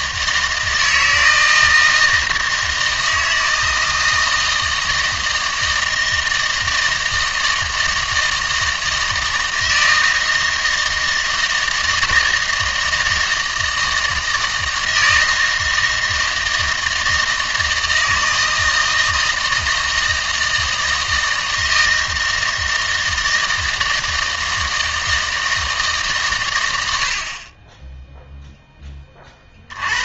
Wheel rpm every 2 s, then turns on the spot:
160, 160, 160, 160, 160, 160, 160, 160, 160, 160, 160, 160, 160, 110, 10.
none